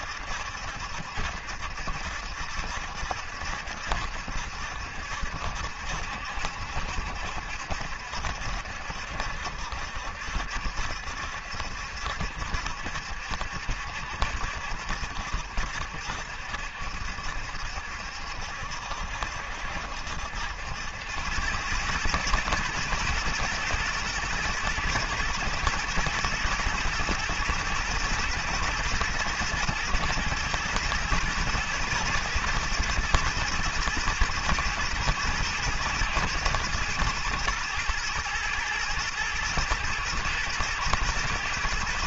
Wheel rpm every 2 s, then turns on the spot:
70, 70, 70, 70, 70, 70, 70, 70, 70, 70, 90, 110, 110, 110, 110, 110, 120, 110, 110, 110, 120.
none